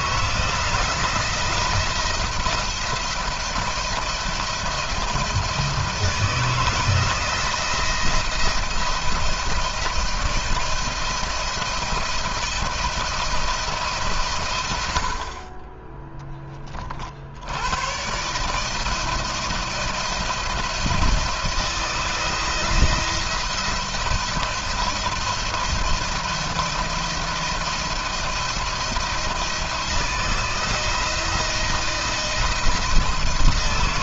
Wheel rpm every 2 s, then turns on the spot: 170, 170, 160, 160, 160, 170, 170, 110, 30, 160, 170, 170, 170, 170, 170, 170, 160.
none